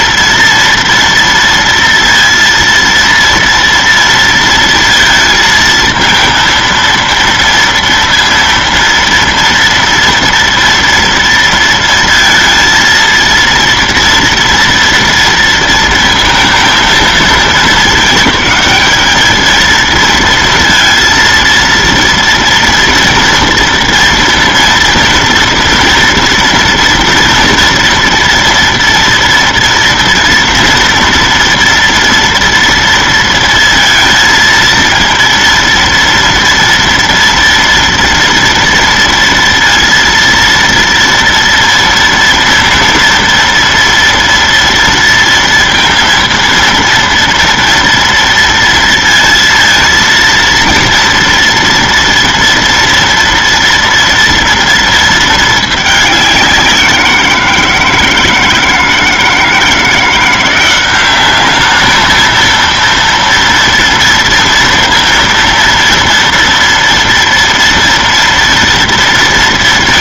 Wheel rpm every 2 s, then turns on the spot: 230, 230, 230, 230, 230, 230, 230, 240, 220, 220, 230, 230, 230, 230, 240, 230, 230, 230, 230, 230, 230, 230, 230, 230, 230, 230, 230, 230, 180, 160, 180, 230, 230, 240, 230.
none